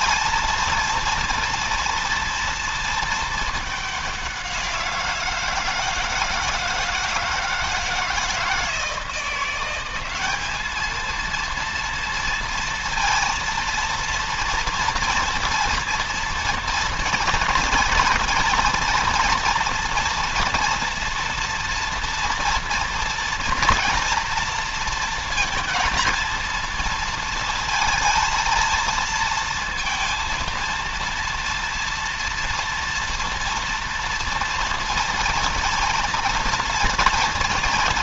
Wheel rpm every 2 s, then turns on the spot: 230, 230, 170, 160, 160, 220, 230, 230, 230, 230, 230, 230, 230, 230, 230, 230, 230, 230, 220.
none